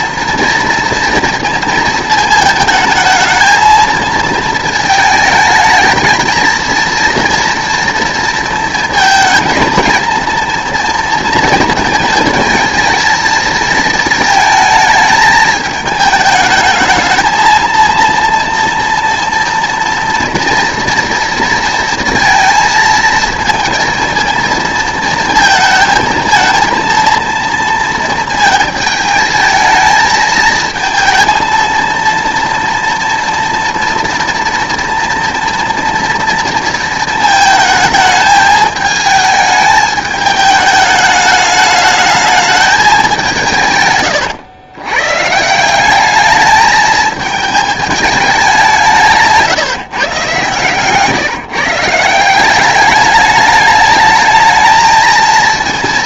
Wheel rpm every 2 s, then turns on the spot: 230, 220, 220, 230, 220, 230, 220, 220, 220, 230, 240, 230, 230, 230, 220, 220, 230, 230, 230, 220, 210, 210, 120, 210, 180, 140, 200, 220.
none